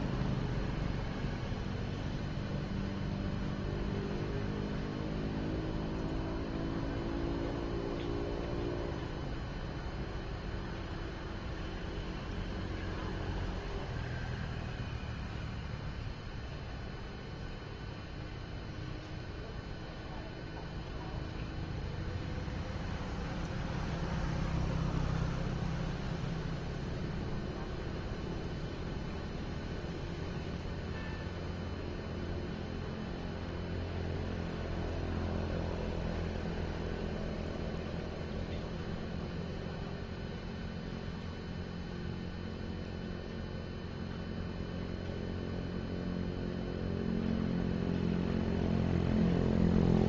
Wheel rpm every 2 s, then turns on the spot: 0, 0, 0, 0, 0, 0, 0, 0, 0, 0, 0, 0, 0, 0, 0, 0, 0, 0, 0, 0, 0, 0, 0, 0, 0.
none